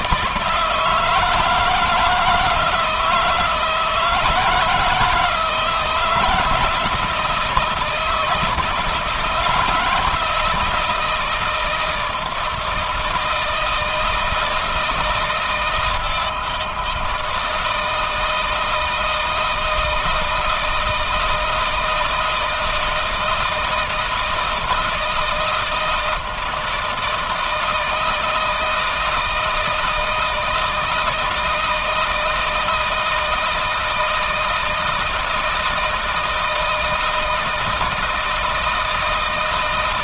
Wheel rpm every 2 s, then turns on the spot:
160, 160, 170, 160, 160, 160, 170, 160, 160, 160, 160, 160, 160, 160, 160, 160, 160, 160, 160, 160.
none